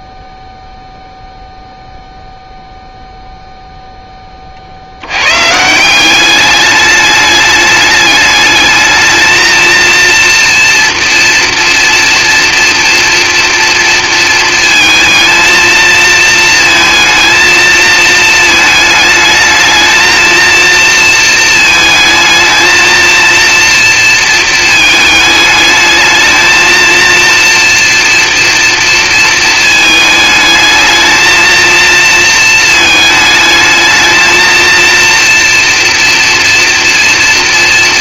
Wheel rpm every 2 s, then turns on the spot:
0, 0, 30, 200, 210, 230, 230, 230, 220, 220, 230, 230, 220, 220, 230, 220, 230, 230, 230.
none